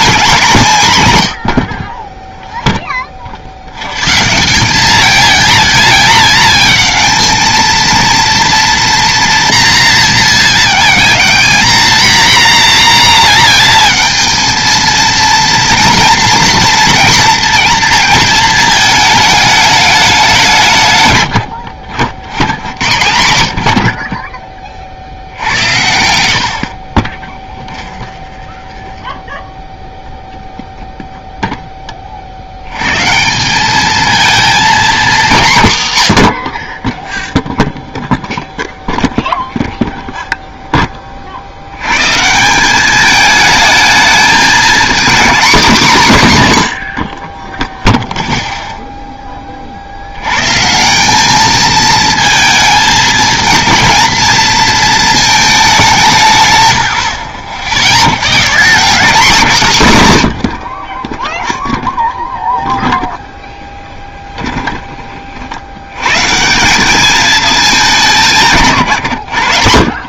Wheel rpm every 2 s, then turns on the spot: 200, 0, 180, 220, 230, 220, 240, 230, 230, 220, 160, 80, 30, 70, 20, 0, 80, 230, 50, 0, 0, 180, 220, 130, 0, 130, 220, 230, 130, 170, 80, 0, 20, 170, 140.
28-30 64-66